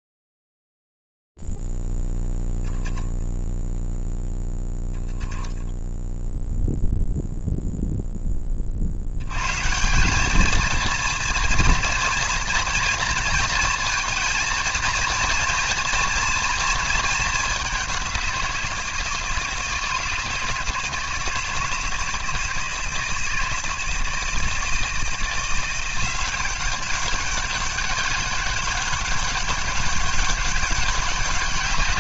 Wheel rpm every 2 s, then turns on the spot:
0, 0, 0, 0, 10, 200, 230, 230, 230, 190, 160, 160, 160, 190, 200, 200.
none